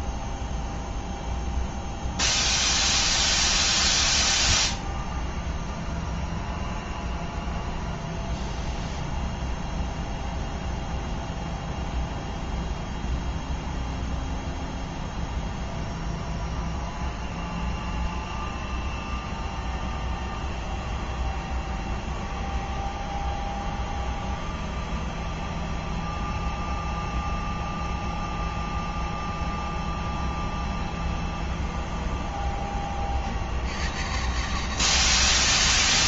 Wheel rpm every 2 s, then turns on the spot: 0, 0, 0, 0, 0, 0, 0, 0, 0, 0, 0, 0, 0, 0, 0, 0, 0, 130.
none